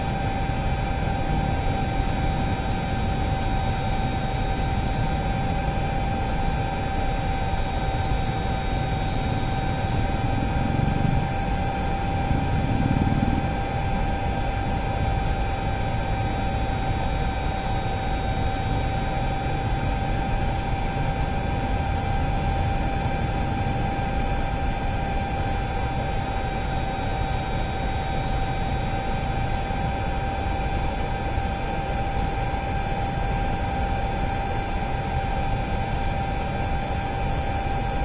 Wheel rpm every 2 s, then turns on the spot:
0, 0, 0, 0, 0, 0, 0, 0, 0, 0, 0, 0, 0, 0, 0, 0, 0, 0, 0.
none